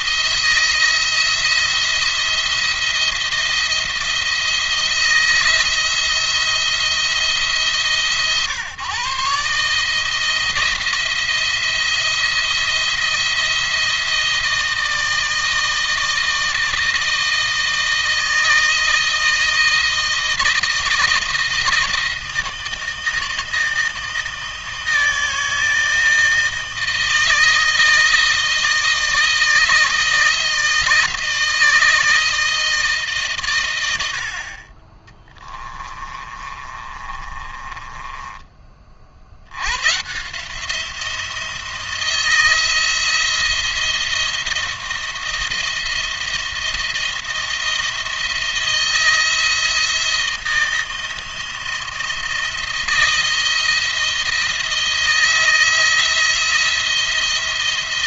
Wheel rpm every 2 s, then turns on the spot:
170, 170, 170, 170, 140, 170, 170, 160, 160, 160, 160, 160, 160, 160, 160, 160, 160, 50, 30, 30, 160, 170, 170, 170, 160, 160, 170, 160, 170.
36-38